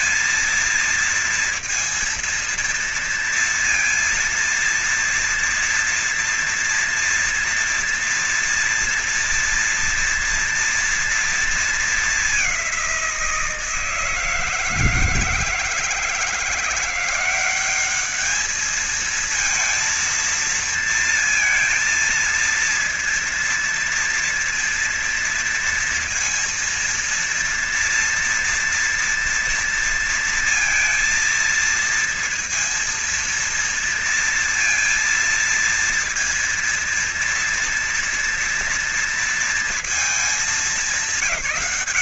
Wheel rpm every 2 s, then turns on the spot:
230, 230, 230, 230, 240, 240, 210, 160, 170, 210, 220, 230, 240, 230, 240, 230, 230, 230, 230, 230, 220.
none